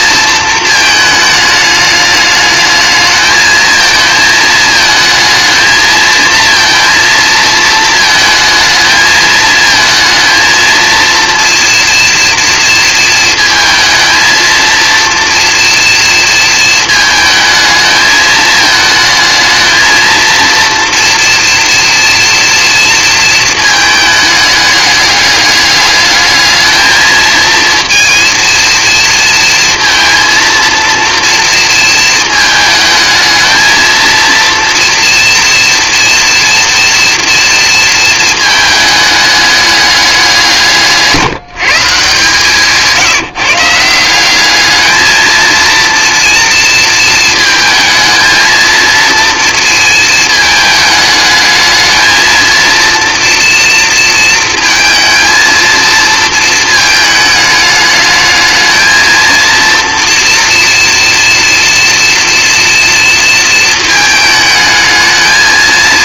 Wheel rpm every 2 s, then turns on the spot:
220, 210, 220, 230, 220, 230, 230, 230, 220, 220, 230, 230, 210, 220, 230, 230, 220, 230, 230, 220, 170, 160, 220, 230, 230, 210, 230, 230, 220, 220, 230, 230, 220.
none